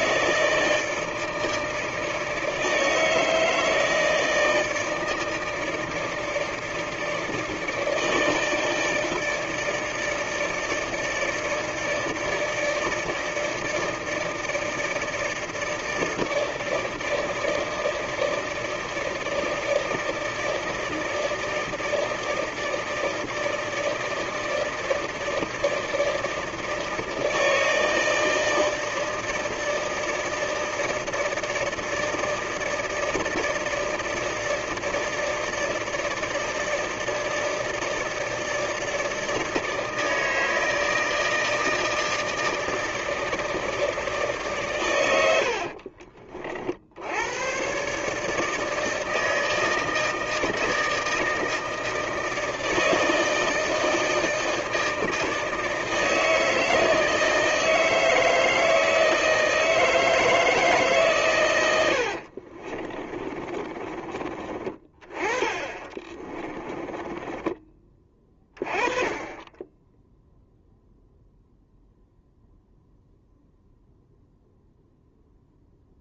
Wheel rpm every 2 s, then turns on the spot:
160, 160, 160, 160, 160, 160, 160, 160, 160, 160, 160, 160, 160, 160, 160, 160, 160, 160, 160, 160, 160, 160, 140, 50, 160, 160, 160, 160, 160, 160, 150, 30, 30, 20, 20, 0, 0, 0.
62-64 66-68